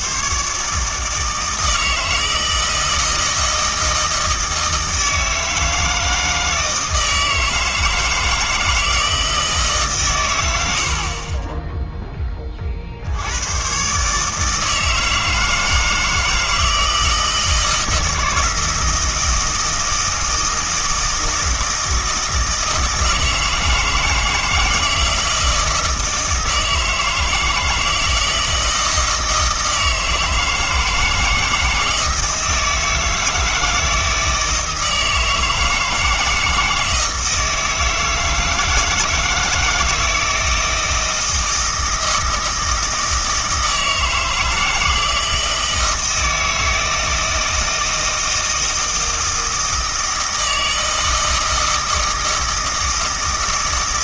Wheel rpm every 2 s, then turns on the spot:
150, 160, 160, 160, 160, 70, 50, 160, 160, 160, 160, 160, 160, 160, 160, 160, 160, 160, 160, 160, 160, 160, 160, 160, 160, 160, 160.
none